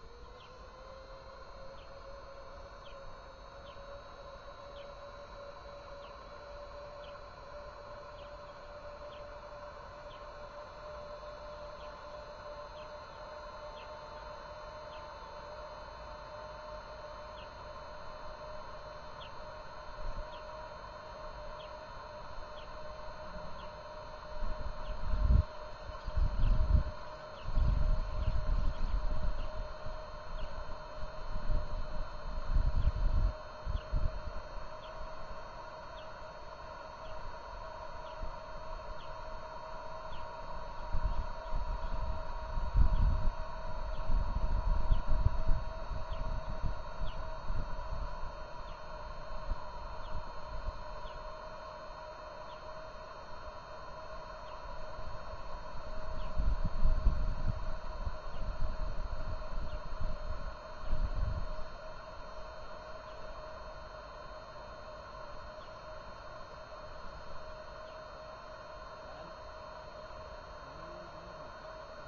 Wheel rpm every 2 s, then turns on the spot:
0, 0, 0, 0, 0, 0, 0, 0, 0, 0, 0, 0, 0, 0, 0, 0, 0, 0, 0, 0, 0, 0, 0, 0, 0, 0, 0, 0, 0, 0, 0, 0, 0, 0, 0, 0.
none